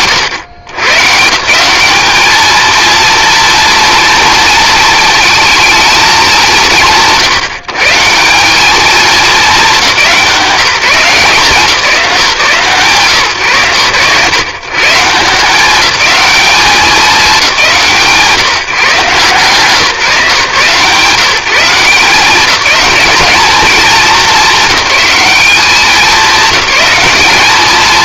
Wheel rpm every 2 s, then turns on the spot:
130, 230, 230, 140, 220, 180, 140, 160, 200, 160, 160, 200, 210, 200.
none